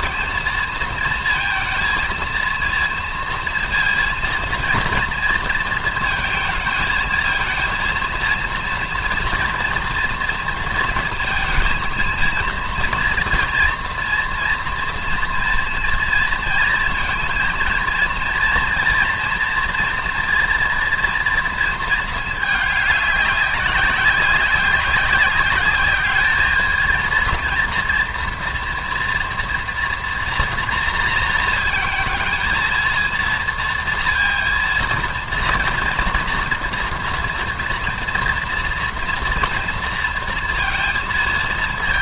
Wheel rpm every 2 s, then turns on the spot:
230, 230, 230, 220, 230, 230, 230, 230, 230, 230, 230, 200, 190, 220, 230, 230, 230, 230, 230, 240, 230.
none